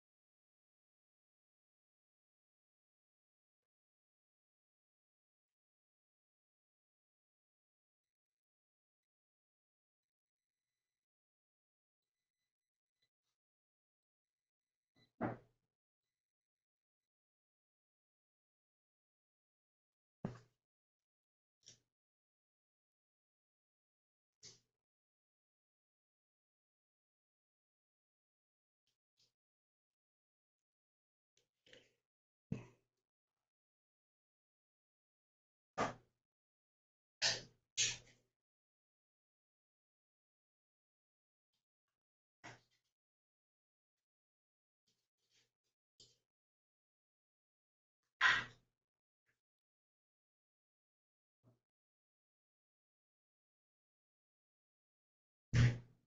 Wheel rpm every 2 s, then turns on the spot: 0, 0, 0, 0, 0, 0, 0, 0, 0, 0, 0, 0, 0, 0, 0, 0, 0, 0, 0, 0, 0, 0, 0, 0, 0, 0, 0, 0.
none